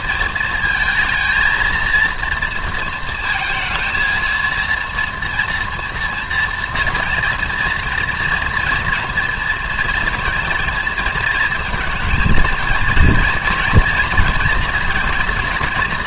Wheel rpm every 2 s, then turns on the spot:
220, 230, 230, 230, 240, 230, 230, 230.
none